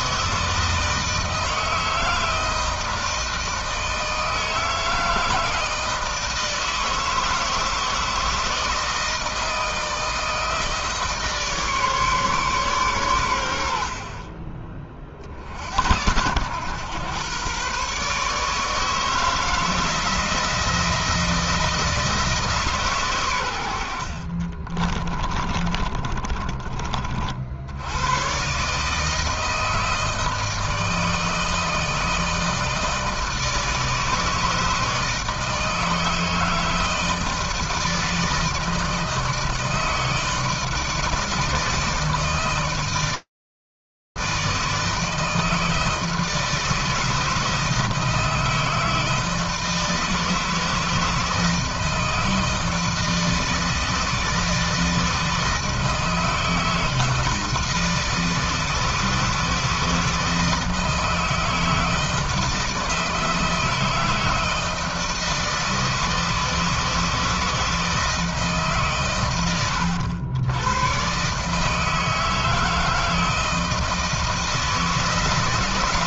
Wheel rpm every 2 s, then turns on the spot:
160, 160, 160, 160, 160, 150, 110, 50, 120, 160, 160, 120, 30, 50, 160, 160, 160, 160, 160, 160, 160, 160, 160, 160, 160, 160, 160, 160, 160, 160, 160, 160, 160, 160, 100, 150, 160, 170.
24-26